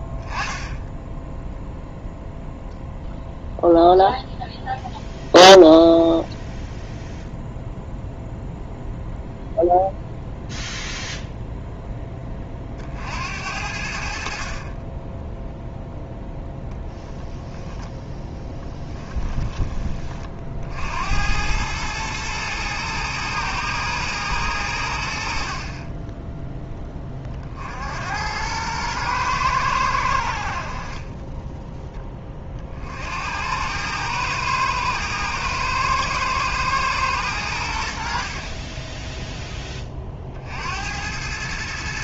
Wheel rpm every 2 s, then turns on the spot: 10, 0, 0, 0, 0, 0, 40, 40, 10, 10, 60, 110, 90, 10, 110, 50, 40, 110, 110, 30, 60.
16-20 38-40